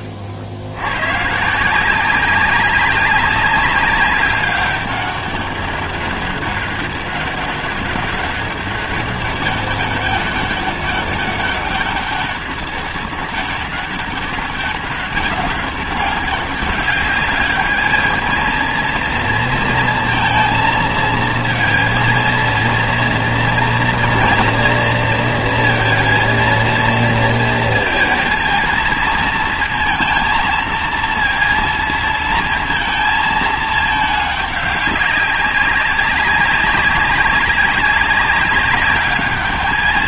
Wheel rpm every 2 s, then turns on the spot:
80, 190, 200, 200, 200, 200, 200, 200, 200, 220, 230, 230, 230, 230, 230, 230, 230, 200, 190, 200.
none